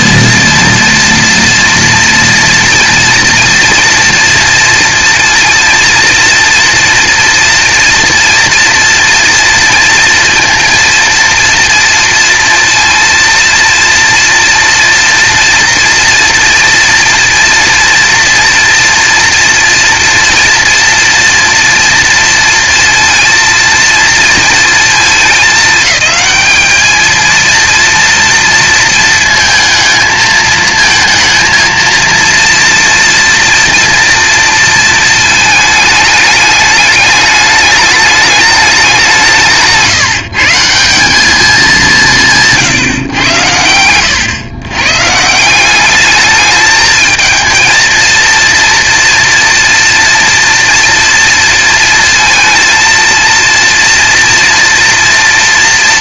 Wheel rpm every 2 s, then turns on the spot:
230, 230, 230, 230, 230, 230, 230, 240, 230, 230, 230, 230, 230, 210, 230, 220, 230, 230, 210, 210, 160, 150, 120, 210, 230, 230, 230, 230.
none